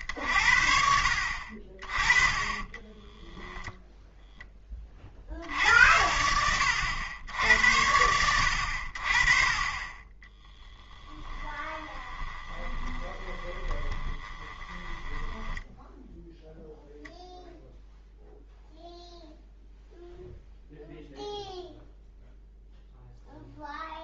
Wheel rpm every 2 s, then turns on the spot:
60, 10, 30, 90, 60, 10, 20, 20, 0, 0, 0, 0.
2-4 10-16